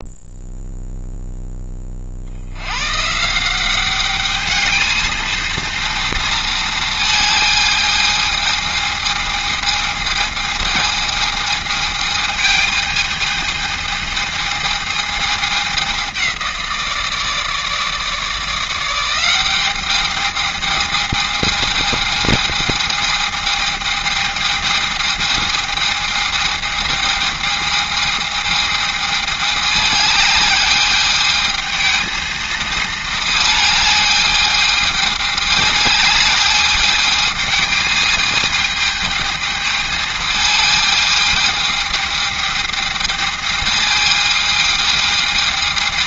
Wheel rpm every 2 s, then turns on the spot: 0, 110, 220, 220, 220, 220, 220, 220, 170, 170, 210, 220, 220, 220, 220, 210, 220, 210, 210, 220, 220, 210, 220.
none